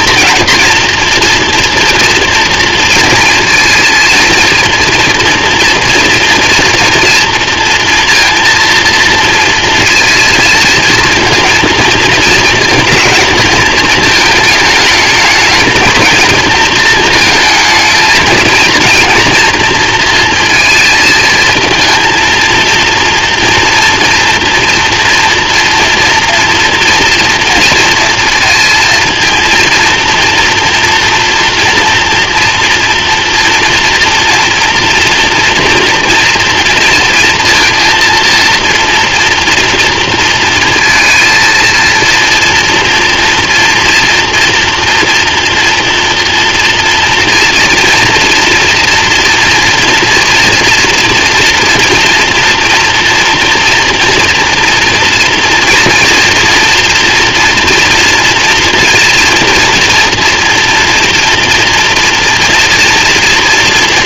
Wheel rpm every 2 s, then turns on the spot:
230, 240, 230, 230, 230, 230, 230, 220, 230, 230, 230, 230, 230, 240, 230, 230, 240, 230, 230, 230, 230, 230, 230, 240, 240, 240, 230, 240, 230, 230, 230, 230.
none